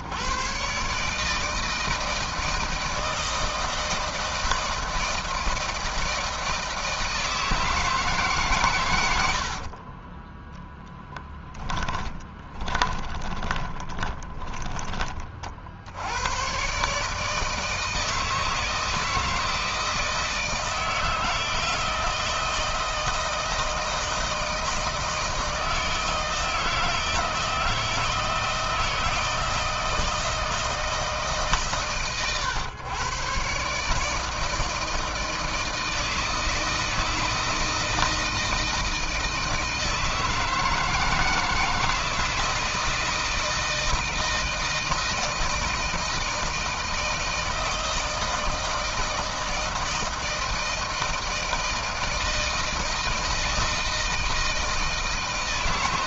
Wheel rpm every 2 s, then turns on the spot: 120, 160, 160, 160, 130, 10, 10, 20, 110, 160, 160, 160, 160, 160, 160, 160, 120, 160, 160, 160, 160, 160, 160, 160, 160, 160, 160, 160.
10-16